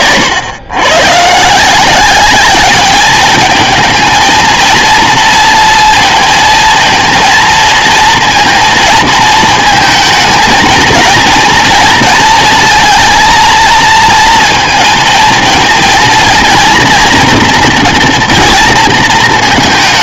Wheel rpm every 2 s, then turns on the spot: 110, 200, 230, 230, 230, 220, 230, 230, 230, 230.
none